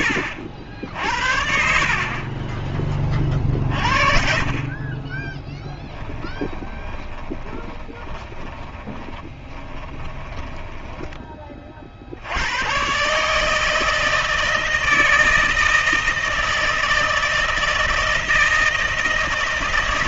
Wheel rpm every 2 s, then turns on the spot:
70, 30, 30, 20, 20, 10, 110, 160, 160, 160.
6-10